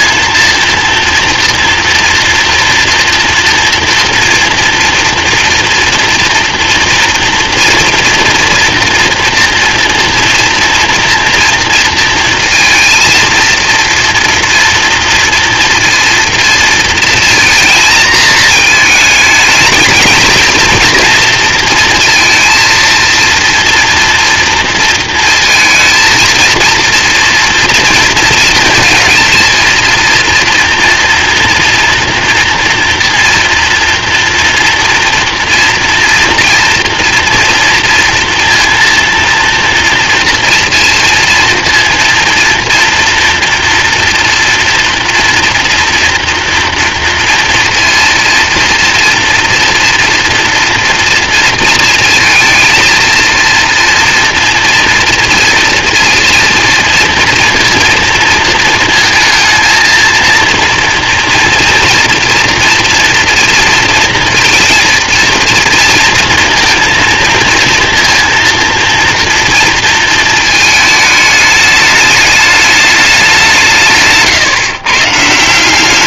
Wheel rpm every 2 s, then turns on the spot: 230, 230, 230, 230, 230, 230, 230, 230, 230, 220, 230, 230, 230, 230, 230, 230, 230, 230, 230, 230, 230, 240, 230, 230, 230, 230, 230, 230, 230, 220, 240, 230, 230, 230, 230, 210, 200, 150.
none